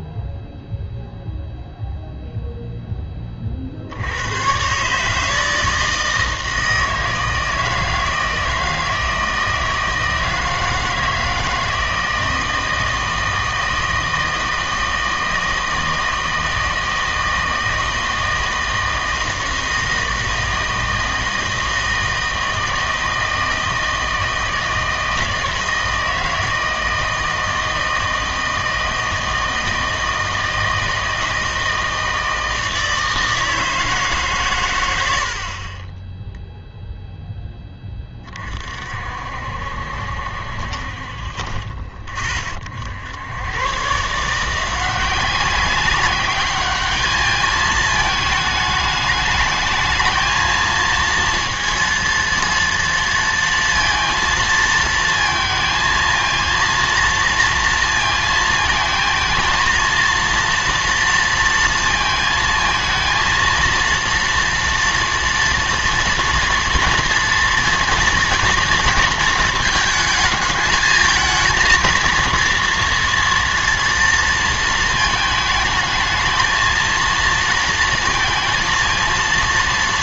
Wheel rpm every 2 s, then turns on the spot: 0, 0, 120, 160, 160, 160, 160, 160, 160, 160, 160, 160, 160, 160, 160, 160, 160, 120, 0, 40, 50, 50, 170, 200, 210, 220, 230, 230, 230, 220, 230, 230, 240, 230, 230, 220, 230, 230, 220, 230.
none